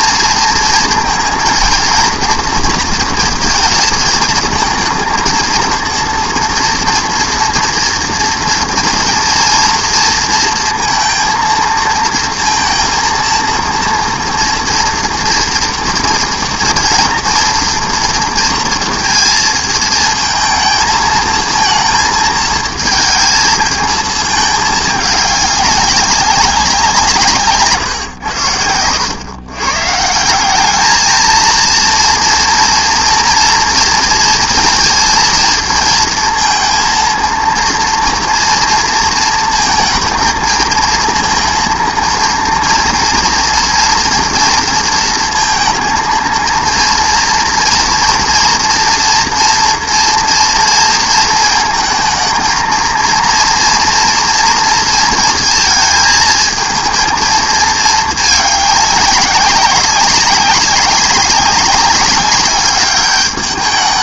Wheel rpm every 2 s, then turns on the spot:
230, 230, 220, 230, 230, 230, 230, 230, 230, 230, 220, 220, 210, 180, 90, 200, 230, 230, 230, 230, 230, 230, 230, 230, 230, 230, 230, 230, 220, 210, 200, 200.
none